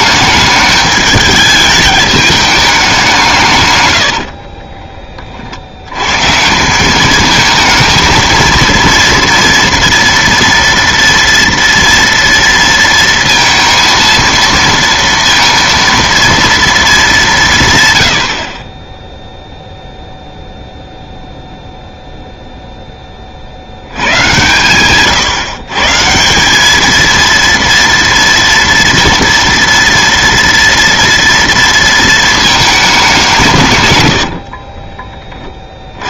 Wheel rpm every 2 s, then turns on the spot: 210, 200, 30, 180, 230, 230, 230, 230, 230, 30, 0, 0, 120, 200, 230, 230, 210, 30.
4-6 34-36